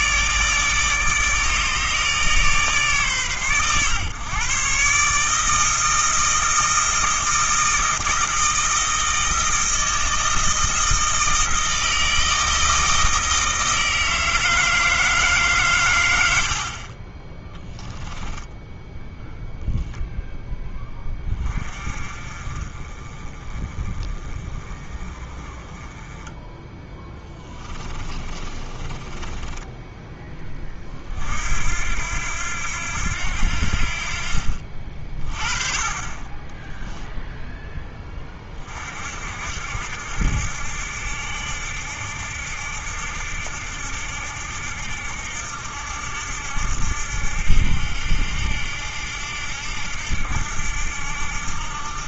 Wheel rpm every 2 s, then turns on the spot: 150, 140, 140, 160, 160, 160, 160, 160, 30, 0, 20, 30, 20, 20, 30, 40, 80, 40, 10, 50, 70, 80, 70, 70, 80, 80.
26-30